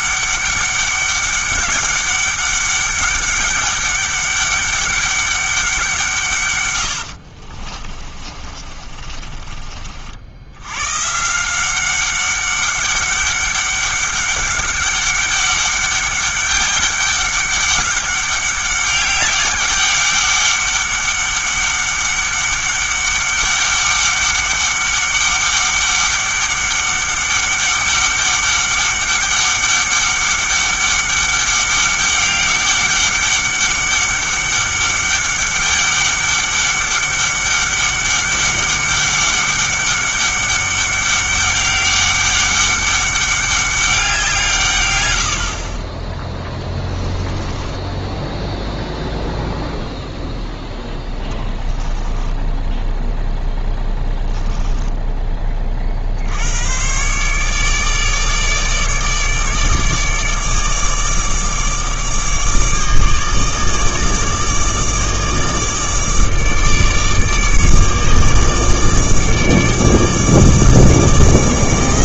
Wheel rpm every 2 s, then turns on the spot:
200, 200, 200, 110, 30, 100, 200, 200, 200, 200, 200, 200, 200, 200, 200, 200, 200, 200, 200, 200, 200, 200, 130, 20, 0, 0, 10, 10, 110, 150, 150, 150, 150, 150, 150, 150.
8-10 46-48 52-56